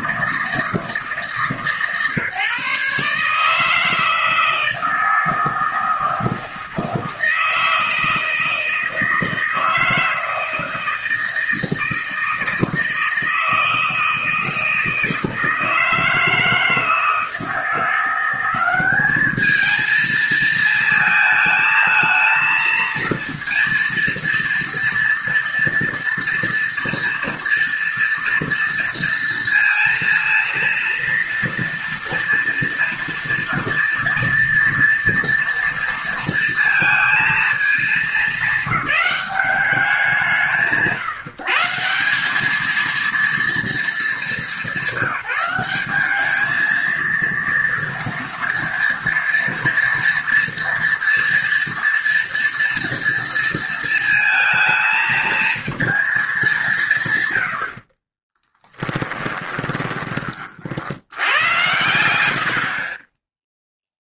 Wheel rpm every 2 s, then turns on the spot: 160, 150, 160, 160, 160, 160, 160, 160, 160, 190, 220, 230, 230, 230, 230, 230, 230, 230, 230, 200, 130, 210, 200, 220, 230, 230, 230, 220, 180, 20, 60, 50.
58-60 62-64